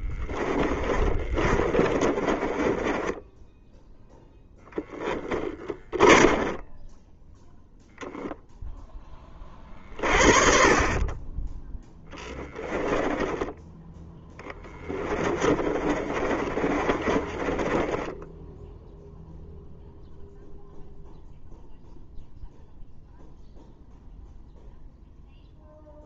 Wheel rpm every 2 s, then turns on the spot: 30, 20, 10, 10, 20, 30, 10, 30, 30, 0, 0, 0, 0.
0-8 12-18